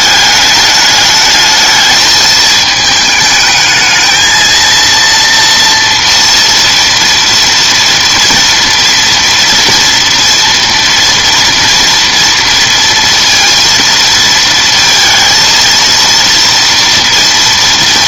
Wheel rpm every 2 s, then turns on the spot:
210, 220, 230, 230, 230, 230, 230, 230, 230.
none